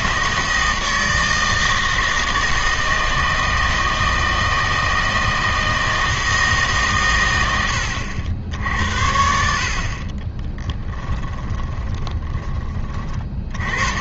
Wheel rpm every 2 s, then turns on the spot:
160, 160, 160, 150, 60, 10, 20.
10-12